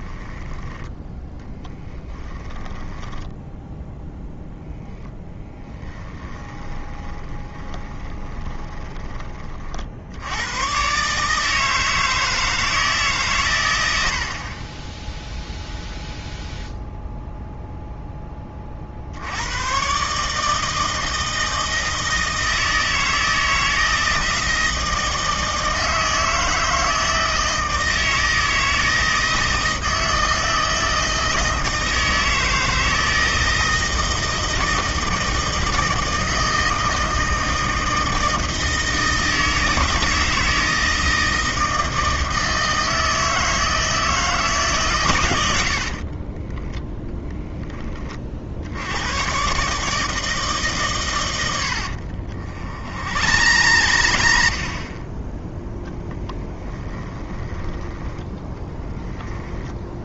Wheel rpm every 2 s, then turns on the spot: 10, 10, 10, 20, 20, 120, 160, 20, 0, 40, 160, 160, 160, 160, 160, 160, 160, 160, 160, 160, 160, 160, 140, 20, 70, 140, 50, 60, 10, 10.
2-4 6-10 46-48 52-54 56-58